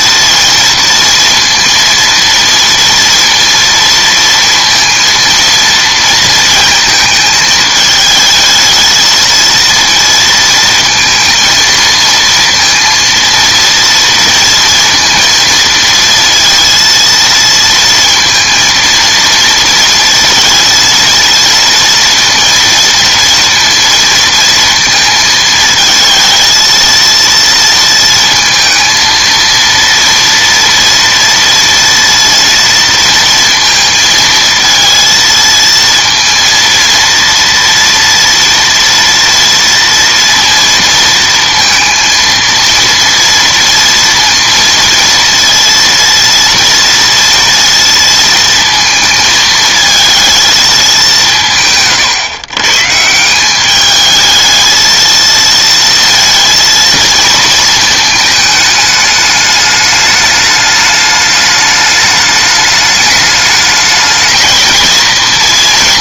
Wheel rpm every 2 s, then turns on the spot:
230, 230, 230, 220, 220, 230, 230, 230, 230, 230, 230, 230, 230, 230, 230, 230, 230, 230, 230, 230, 230, 230, 230, 230, 230, 220, 140, 220, 230, 210, 210, 210, 220.
none